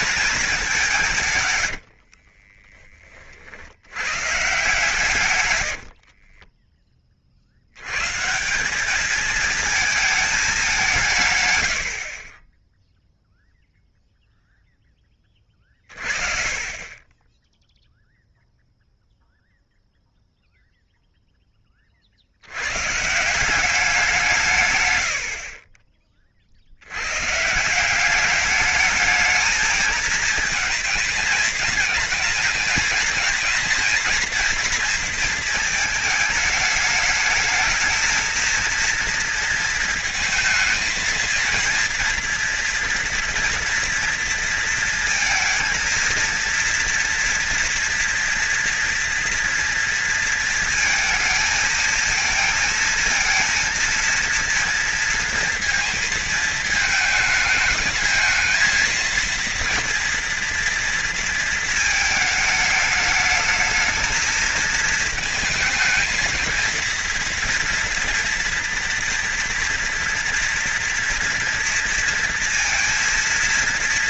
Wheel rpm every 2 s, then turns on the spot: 190, 30, 150, 20, 200, 180, 10, 10, 30, 0, 0, 140, 110, 80, 210, 220, 220, 230, 210, 230, 220, 230, 230, 230, 230, 230, 230, 230, 220, 230, 230, 210, 220, 230, 230, 230, 230.
none